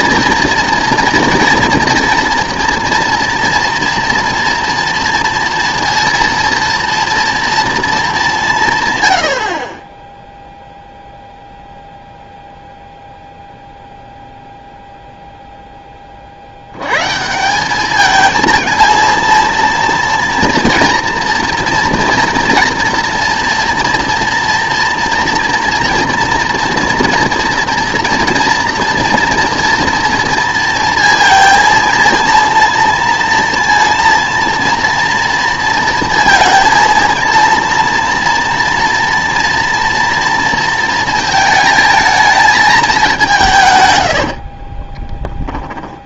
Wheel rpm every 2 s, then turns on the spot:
230, 230, 230, 230, 130, 0, 0, 0, 90, 230, 230, 230, 230, 240, 240, 230, 230, 230, 230, 230, 230, 210, 30.
44-46